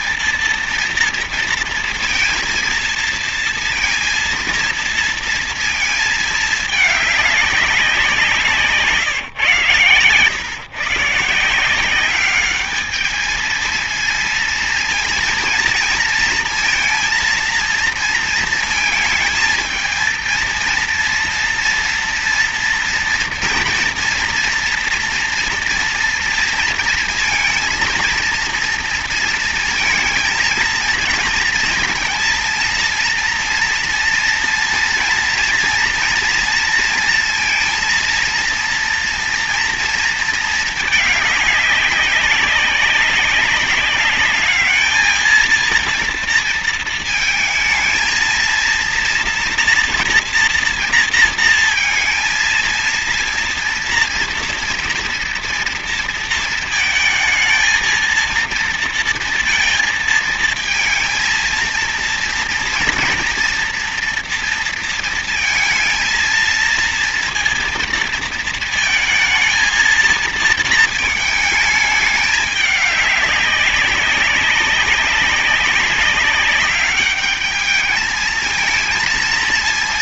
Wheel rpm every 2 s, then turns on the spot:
230, 230, 230, 220, 180, 130, 210, 230, 230, 220, 230, 230, 240, 230, 230, 230, 230, 230, 230, 230, 220, 200, 210, 230, 230, 230, 230, 230, 230, 230, 220, 230, 230, 230, 230, 230, 210, 190, 200, 220.
none